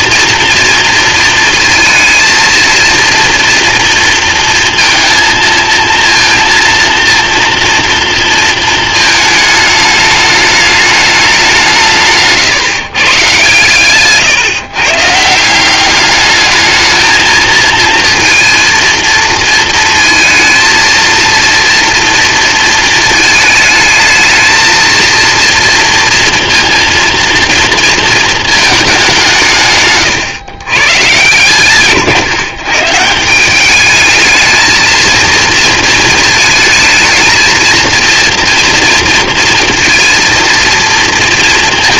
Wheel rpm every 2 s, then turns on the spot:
230, 230, 230, 230, 220, 210, 150, 130, 220, 230, 230, 230, 220, 230, 220, 120, 130, 220, 220, 230, 230.
none